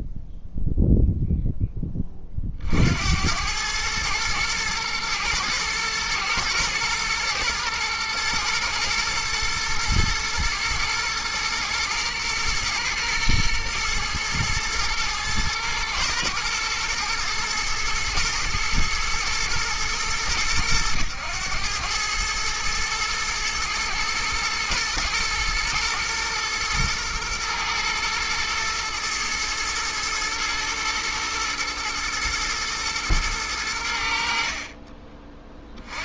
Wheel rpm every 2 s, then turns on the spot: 0, 50, 110, 110, 110, 110, 120, 110, 120, 110, 100, 110, 110, 120, 110, 120, 110, 50.
none